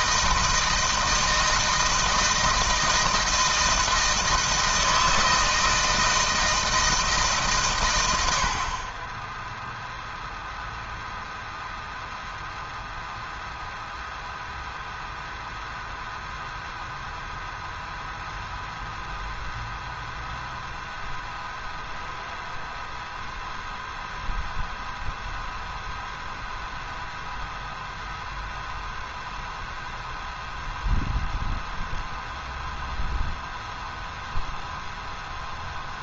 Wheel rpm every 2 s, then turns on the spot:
160, 160, 160, 160, 80, 0, 0, 0, 0, 0, 0, 0, 0, 0, 0, 0, 0, 0.
none